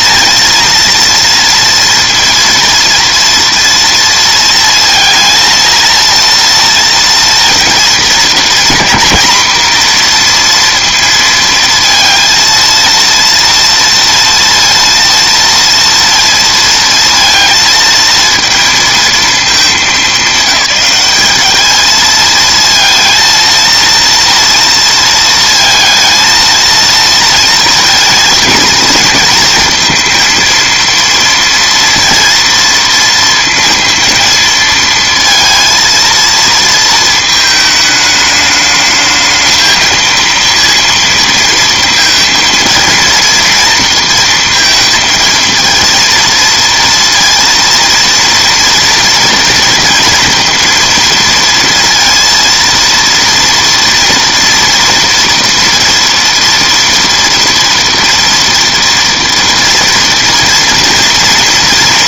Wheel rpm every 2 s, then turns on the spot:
230, 230, 230, 230, 240, 240, 230, 230, 230, 230, 210, 230, 230, 230, 230, 230, 230, 230, 230, 210, 230, 230, 230, 230, 230, 230, 230, 230, 240, 230, 230.
none